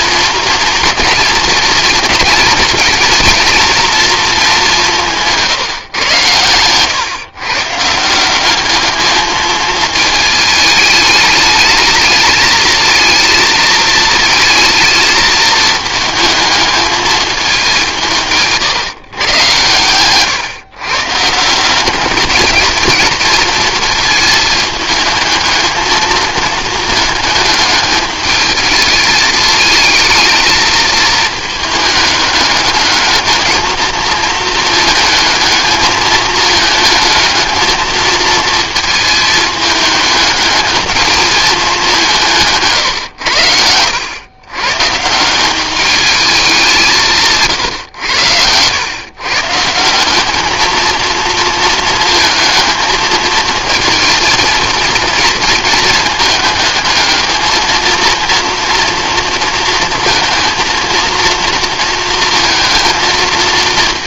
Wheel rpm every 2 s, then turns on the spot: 230, 230, 190, 120, 200, 210, 220, 220, 220, 140, 130, 220, 220, 220, 220, 220, 210, 220, 220, 230, 220, 140, 120, 190, 110, 220, 220, 230, 210, 230, 230, 230.
none